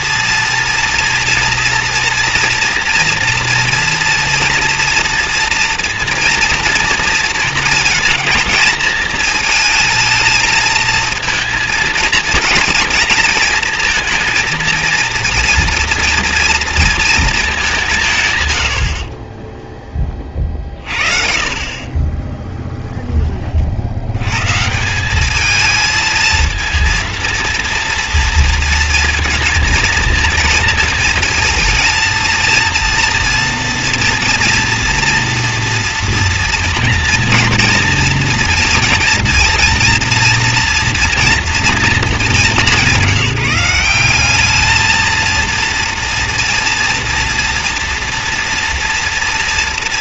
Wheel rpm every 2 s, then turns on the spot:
230, 230, 230, 230, 220, 220, 220, 230, 230, 110, 40, 10, 140, 230, 230, 230, 230, 230, 230, 230, 230, 200, 200, 230, 240.
22-24